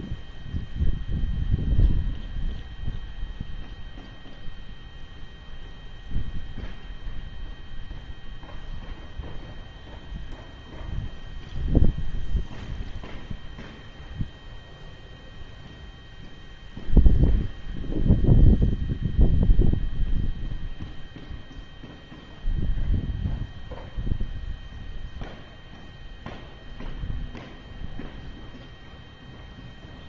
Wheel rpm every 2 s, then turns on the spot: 0, 0, 0, 0, 0, 0, 0, 0, 0, 0, 0, 0, 0, 0, 0.
none